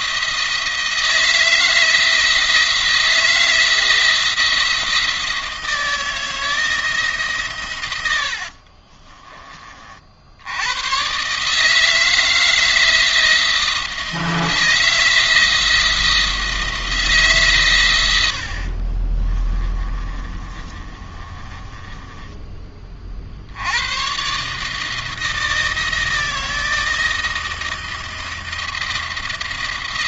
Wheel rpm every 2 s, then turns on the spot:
160, 160, 170, 160, 50, 110, 160, 160, 160, 40, 30, 30, 150, 170, 170.
8-10 18-22